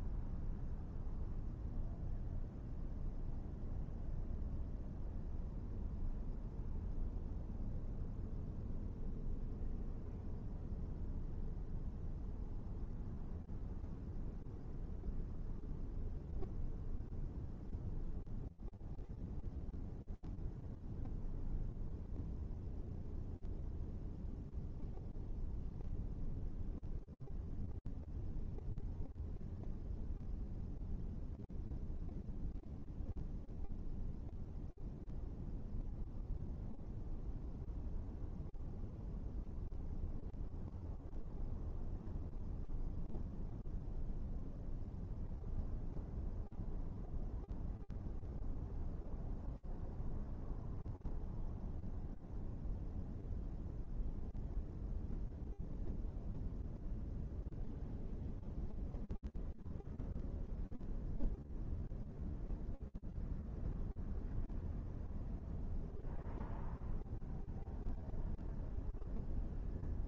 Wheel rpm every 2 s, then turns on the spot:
0, 0, 0, 0, 0, 0, 0, 0, 0, 0, 0, 0, 0, 0, 0, 0, 0, 0, 0, 0, 0, 0, 0, 0, 0, 0, 0, 0, 0, 0, 0, 0, 0, 0, 0.
none